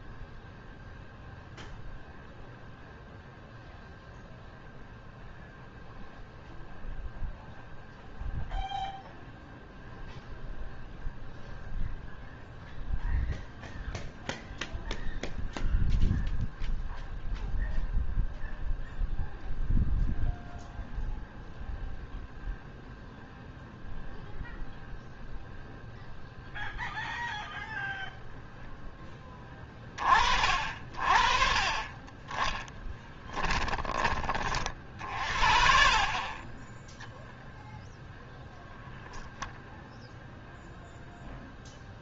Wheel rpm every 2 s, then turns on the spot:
0, 0, 0, 0, 0, 0, 0, 0, 0, 0, 0, 0, 0, 0, 0, 30, 20, 30, 20, 0, 0.
none